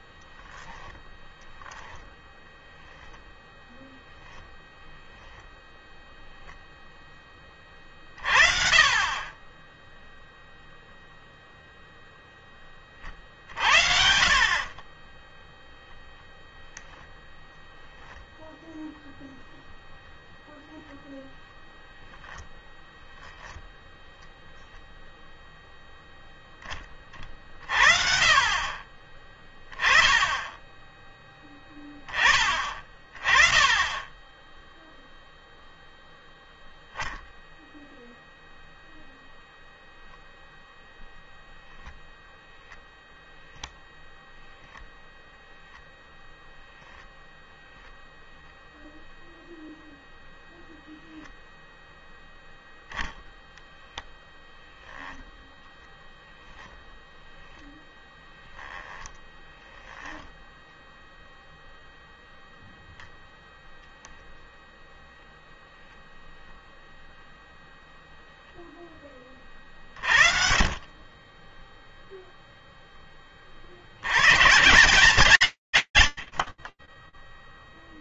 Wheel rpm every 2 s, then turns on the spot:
0, 20, 10, 0, 40, 0, 0, 40, 0, 0, 0, 0, 0, 0, 40, 10, 20, 10, 0, 0, 0, 0, 0, 10, 0, 0, 0, 0, 0, 10, 0, 0, 0, 0, 0, 50, 0, 120, 10.
4-6 14-16 46-48 58-60